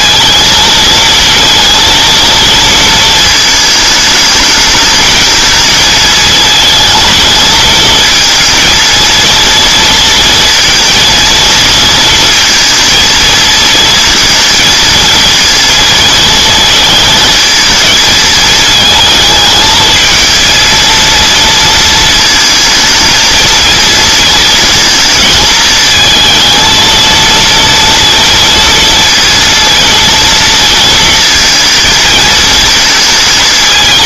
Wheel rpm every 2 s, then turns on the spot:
230, 230, 210, 220, 220, 230, 230, 230, 220, 220, 230, 220, 220, 230, 230, 230, 220.
none